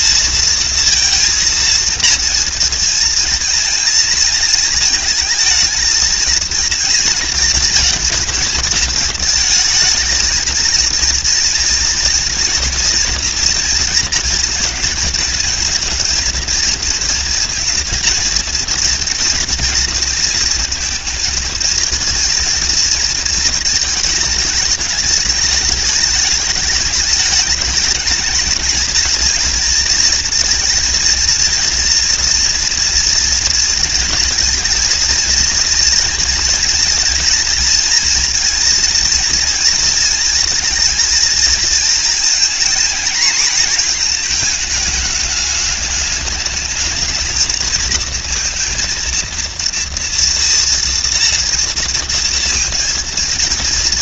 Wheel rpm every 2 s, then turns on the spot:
230, 230, 230, 220, 230, 230, 230, 220, 230, 230, 230, 220, 210, 210, 220, 230, 230, 230, 230, 230, 220, 230, 210, 210, 230, 230, 230.
none